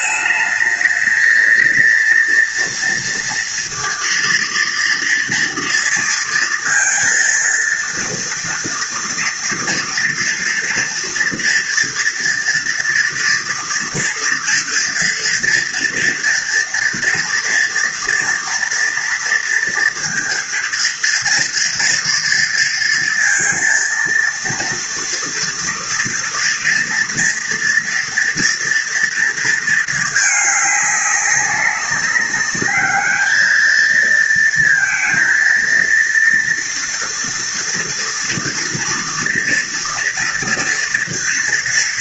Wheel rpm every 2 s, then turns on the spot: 220, 230, 230, 230, 230, 230, 240, 230, 230, 230, 230, 230, 230, 230, 230, 200, 210, 230, 230, 230, 230.
none